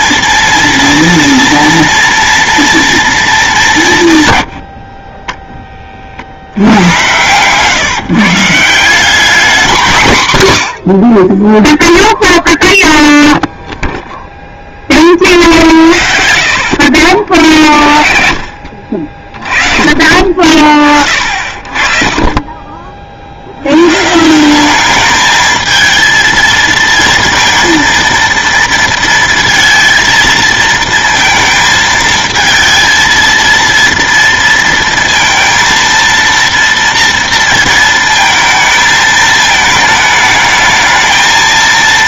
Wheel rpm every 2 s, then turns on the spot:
230, 230, 70, 90, 170, 90, 0, 20, 60, 60, 40, 40, 200, 230, 230, 230, 230, 230, 230, 220, 220.
16-18